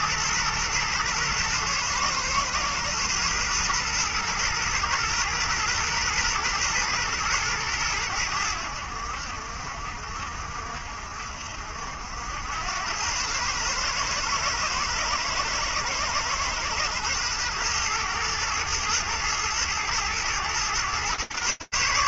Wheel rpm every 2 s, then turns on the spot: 120, 120, 120, 120, 80, 60, 100, 110, 110, 110, 120.
none